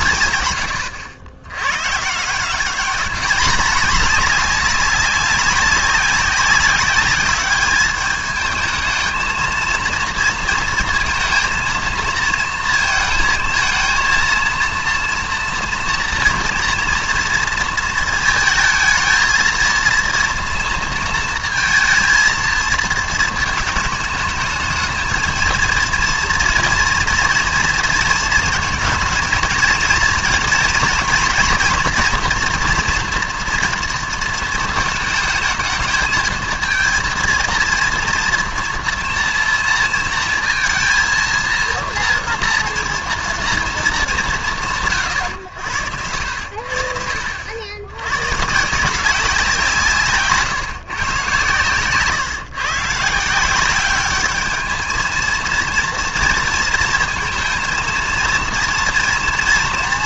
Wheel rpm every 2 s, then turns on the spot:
120, 190, 200, 200, 220, 230, 230, 230, 230, 220, 230, 220, 220, 230, 230, 230, 230, 220, 220, 230, 230, 230, 170, 70, 150, 140, 140, 220, 230, 230.
none